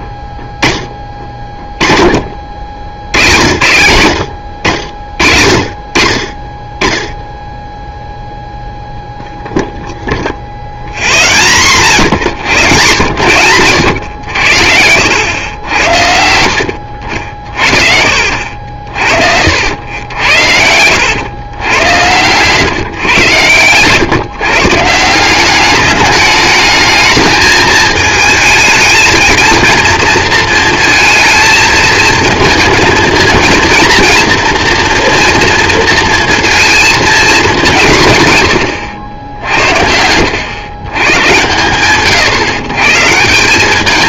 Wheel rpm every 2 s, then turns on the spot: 10, 70, 70, 10, 0, 0, 100, 80, 70, 60, 90, 130, 140, 210, 220, 230, 220, 230, 230, 110, 110, 130.
14-20